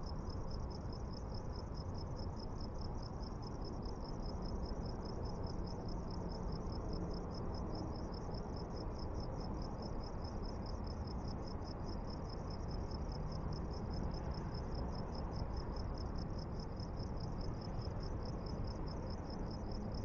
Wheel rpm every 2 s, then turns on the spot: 0, 0, 0, 0, 0, 0, 0, 0, 0, 0.
none